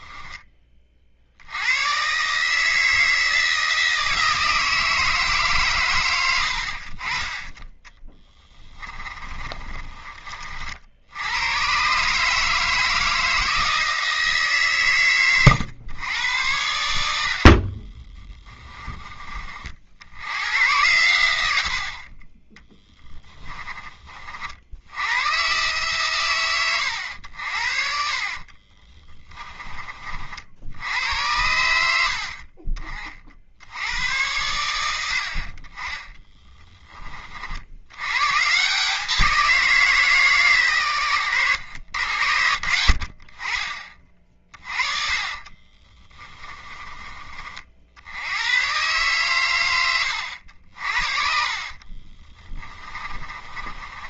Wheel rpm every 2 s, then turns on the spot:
30, 160, 160, 60, 20, 60, 160, 120, 90, 20, 100, 20, 80, 100, 30, 80, 40, 80, 20, 170, 120, 70, 40, 30, 130, 60, 20.
8-10 22-24 28-30 44-46 50-54